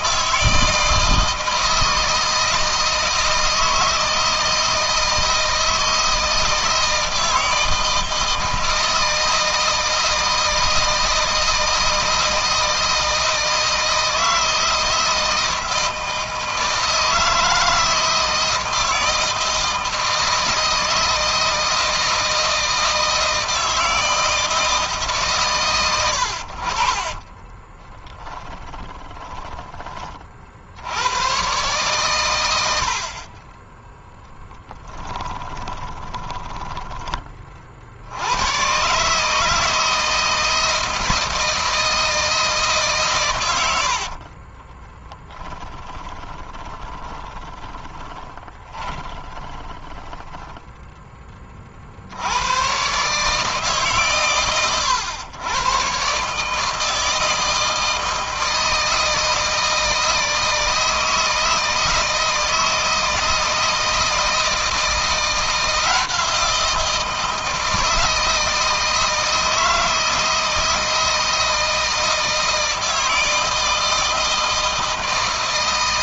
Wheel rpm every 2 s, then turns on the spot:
160, 160, 160, 160, 160, 160, 160, 160, 160, 160, 160, 160, 160, 50, 20, 90, 60, 10, 20, 140, 160, 130, 10, 20, 20, 10, 140, 100, 150, 160, 160, 160, 170, 160, 160, 160, 160, 160.
26-30 34-36 44-50